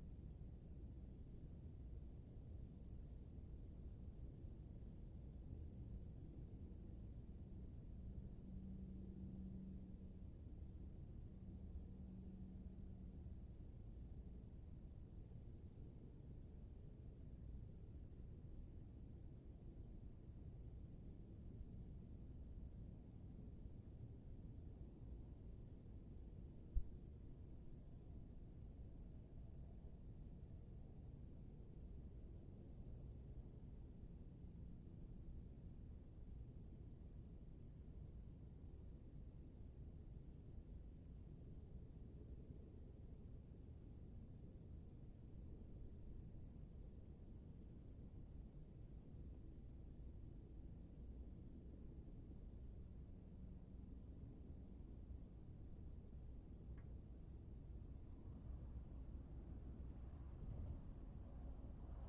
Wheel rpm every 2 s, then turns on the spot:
0, 0, 0, 0, 0, 0, 0, 0, 0, 0, 0, 0, 0, 0, 0, 0, 0, 0, 0, 0, 0, 0, 0, 0, 0, 0, 0, 0, 0, 0, 0.
none